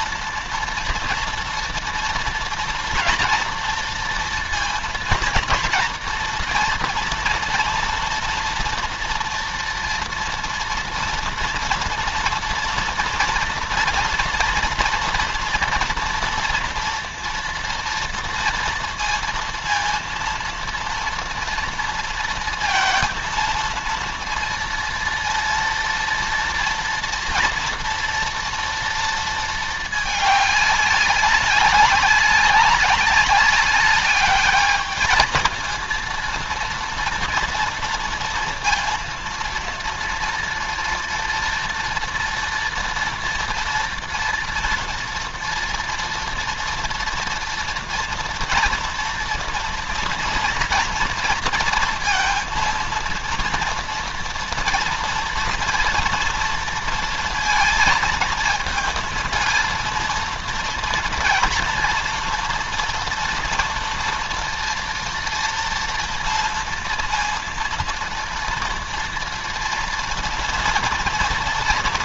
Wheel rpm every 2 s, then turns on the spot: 230, 230, 230, 230, 230, 230, 240, 240, 230, 230, 230, 230, 230, 230, 230, 200, 190, 210, 230, 230, 230, 230, 240, 230, 230, 230, 230, 230, 230, 230, 230, 230, 240, 230, 230, 230.
none